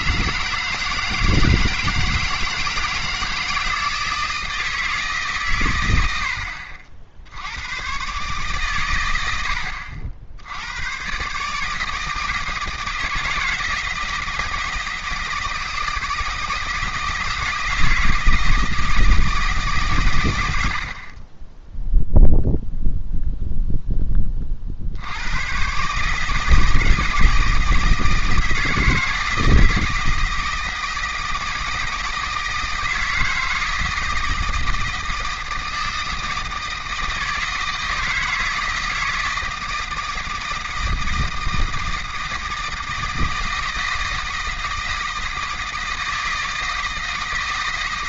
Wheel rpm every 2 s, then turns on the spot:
160, 160, 160, 60, 120, 100, 160, 160, 160, 160, 80, 0, 60, 160, 160, 160, 160, 160, 160, 160, 160, 160, 160, 160.
none